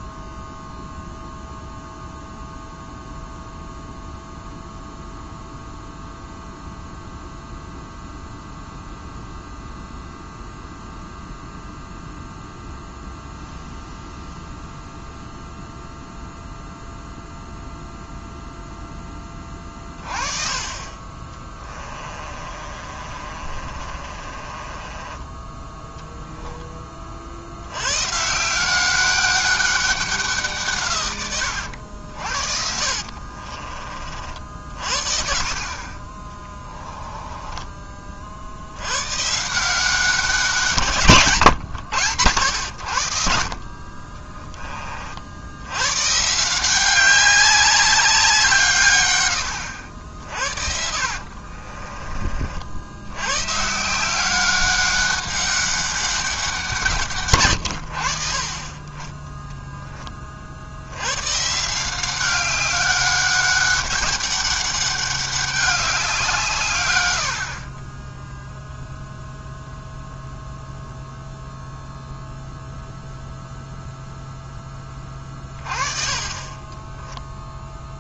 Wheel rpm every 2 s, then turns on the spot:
0, 0, 0, 0, 0, 0, 0, 0, 0, 0, 30, 40, 30, 20, 190, 130, 50, 60, 10, 90, 150, 80, 30, 180, 140, 50, 70, 190, 160, 20, 80, 200, 200, 120, 0, 0, 0, 20, 10.
22-26 32-34 36-38 50-52 76-78